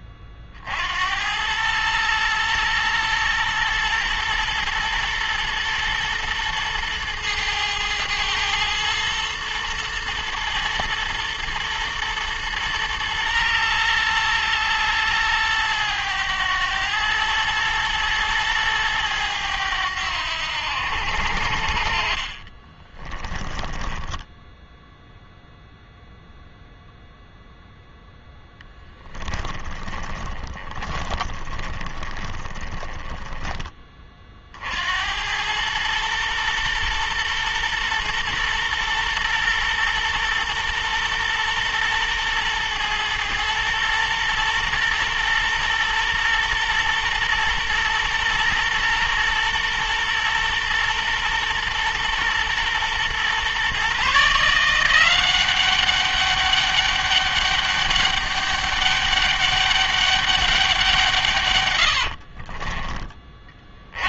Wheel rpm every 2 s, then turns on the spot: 60, 120, 110, 110, 110, 110, 120, 110, 110, 110, 90, 30, 0, 0, 10, 30, 20, 60, 120, 120, 120, 110, 120, 120, 120, 120, 120, 170, 200, 200, 190, 30.
22-24 28-34